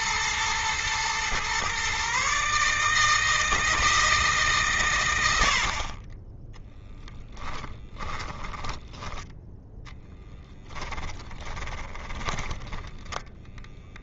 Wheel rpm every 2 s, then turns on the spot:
120, 160, 90, 10, 10, 20, 10.
6-8 10-12